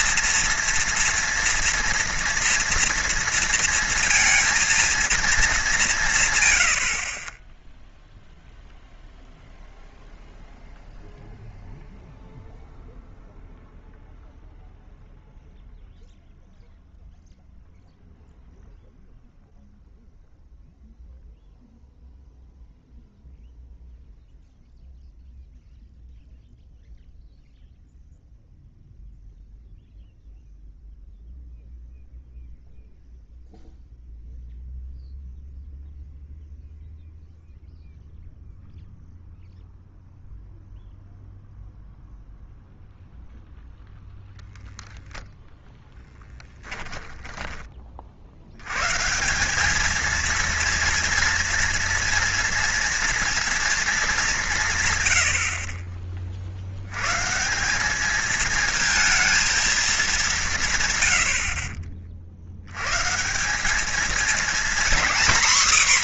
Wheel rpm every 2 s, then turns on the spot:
230, 230, 230, 80, 0, 0, 0, 0, 0, 0, 0, 0, 0, 0, 0, 0, 0, 0, 0, 0, 0, 0, 0, 10, 110, 230, 230, 140, 90, 220, 140, 120, 250.
46-48